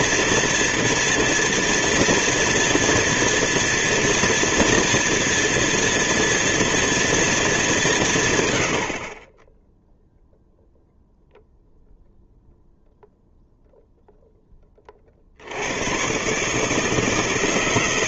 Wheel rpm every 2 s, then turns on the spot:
230, 230, 230, 230, 100, 0, 0, 20, 150.
none